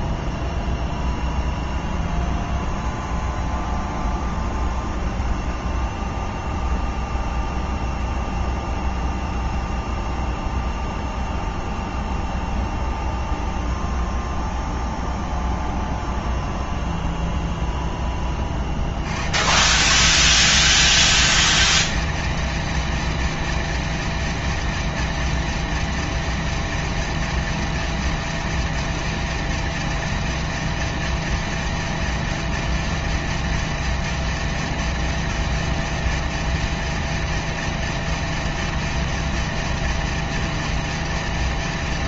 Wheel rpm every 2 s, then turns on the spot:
0, 0, 0, 0, 0, 0, 0, 0, 0, 60, 210, 230, 230, 230, 230, 230, 230, 230, 230, 230, 230.
none